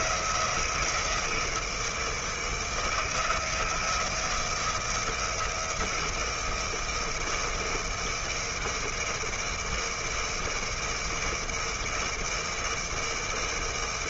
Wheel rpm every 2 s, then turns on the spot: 170, 160, 170, 160, 160, 160, 160.
none